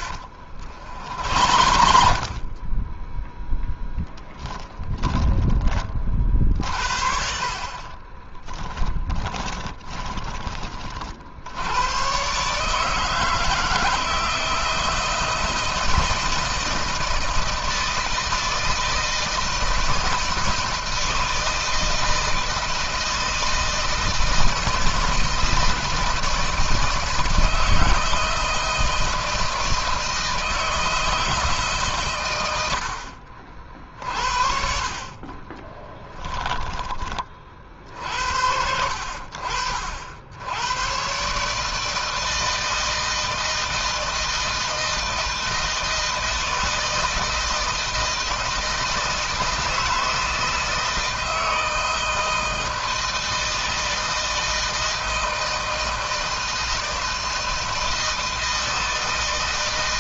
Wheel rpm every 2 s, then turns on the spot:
60, 30, 10, 60, 20, 30, 140, 160, 170, 160, 160, 160, 160, 160, 160, 160, 110, 50, 10, 70, 90, 160, 160, 160, 160, 160, 160, 160, 160, 160.
0-2 4-6 8-10